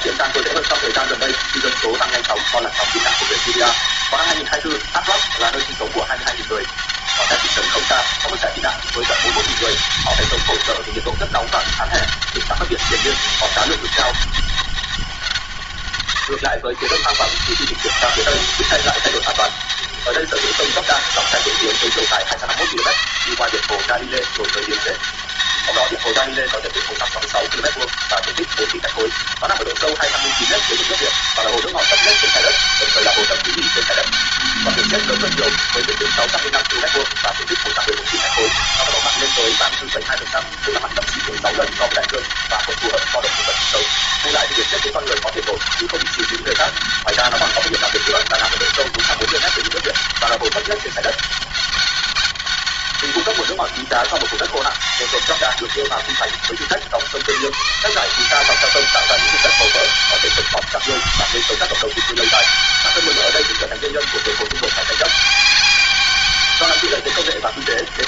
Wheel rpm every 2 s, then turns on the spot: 200, 200, 200, 200, 200, 200, 200, 190, 110, 190, 200, 170, 200, 200, 200, 200, 200, 200, 200, 200, 200, 200, 190, 200, 190, 190, 190, 200, 190, 190, 200, 200, 200, 200.
none